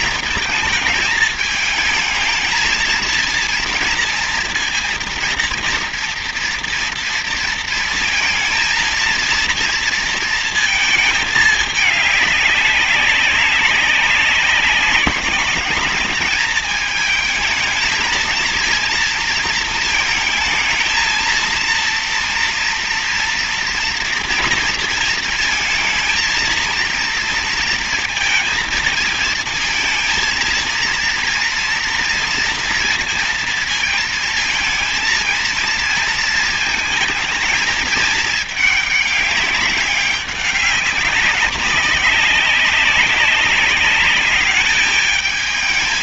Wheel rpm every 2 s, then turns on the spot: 220, 230, 230, 230, 230, 220, 190, 190, 220, 230, 230, 240, 230, 230, 220, 230, 230, 230, 230, 210, 190, 190, 210.
none